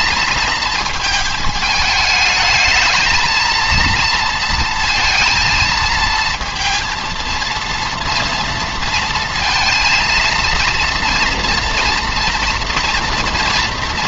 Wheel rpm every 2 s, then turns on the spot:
220, 220, 230, 230, 230, 230, 230.
none